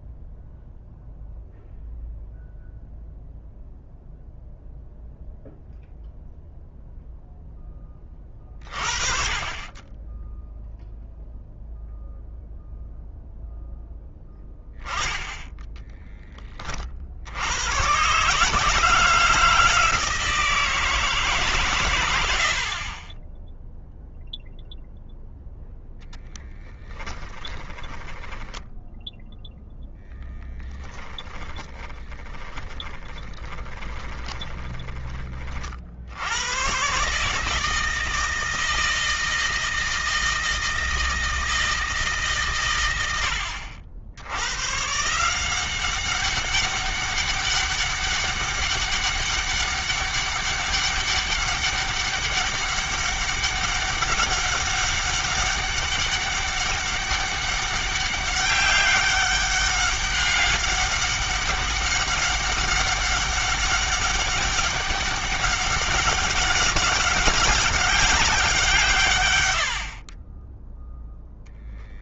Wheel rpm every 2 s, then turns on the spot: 0, 0, 0, 0, 30, 0, 0, 20, 30, 160, 160, 60, 0, 10, 10, 30, 30, 20, 110, 160, 160, 120, 120, 190, 200, 200, 200, 200, 200, 200, 200, 200, 200, 200, 160, 10.
28-36